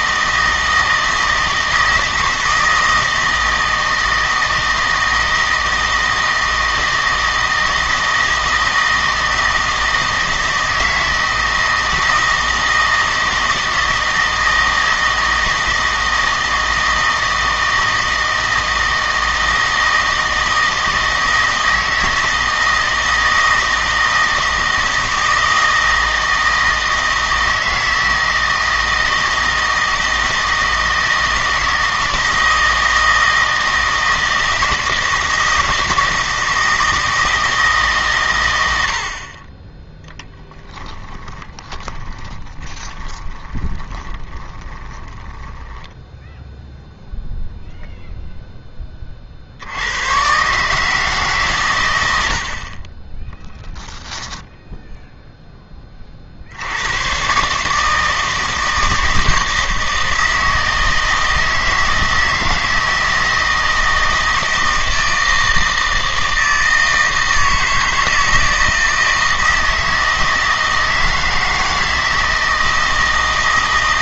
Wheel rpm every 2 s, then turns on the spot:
160, 160, 160, 160, 160, 160, 160, 160, 160, 160, 160, 160, 160, 160, 160, 160, 160, 160, 160, 90, 10, 20, 20, 0, 10, 150, 40, 0, 90, 160, 160, 160, 160, 160, 160, 160, 160.
40-46 52-54